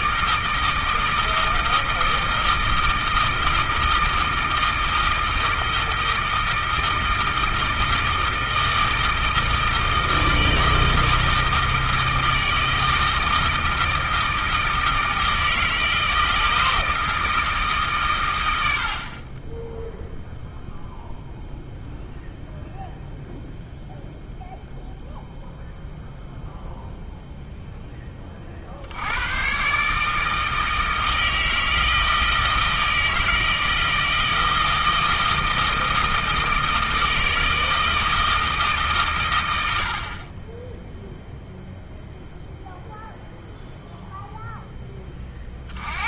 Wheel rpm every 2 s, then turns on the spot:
160, 160, 160, 160, 160, 160, 160, 160, 160, 70, 0, 0, 0, 0, 80, 160, 160, 160, 160, 140, 10, 0, 20.
none